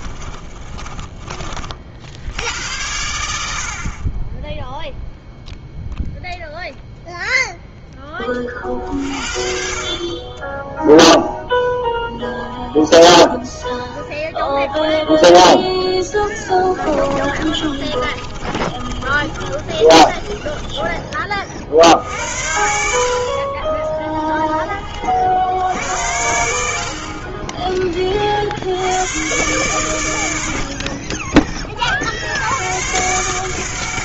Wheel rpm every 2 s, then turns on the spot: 20, 90, 0, 0, 40, 0, 0, 0, 20, 30, 20, 60, 30, 60, 90, 50, 110.
0-2 16-20 30-32